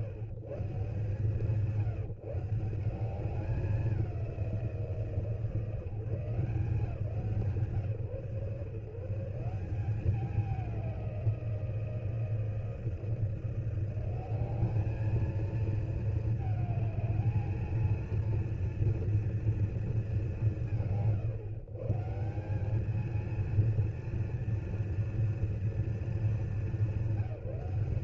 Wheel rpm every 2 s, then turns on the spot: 130, 170, 170, 160, 140, 200, 170, 200, 220, 230, 150, 190, 230, 200.
none